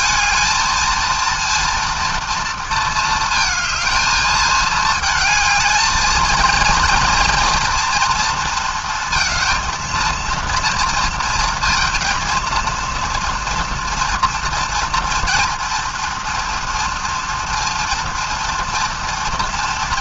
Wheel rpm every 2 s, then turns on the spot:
220, 230, 220, 230, 230, 230, 230, 230, 230, 230.
none